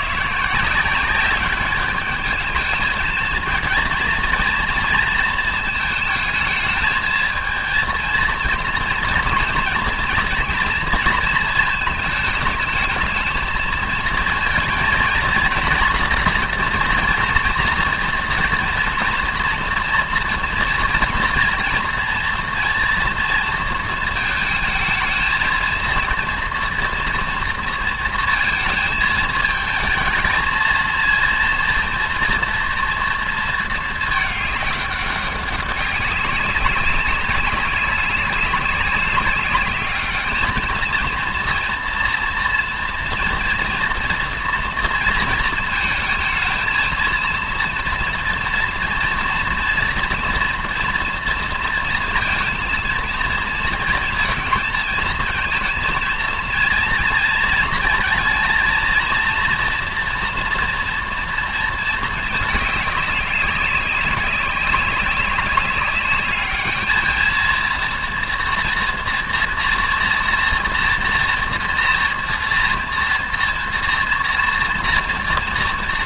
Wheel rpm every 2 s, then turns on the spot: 160, 220, 230, 220, 230, 230, 220, 230, 240, 230, 230, 230, 220, 240, 230, 220, 230, 210, 200, 200, 210, 230, 230, 220, 230, 230, 230, 230, 230, 230, 230, 210, 200, 210, 230, 230, 230, 230.
none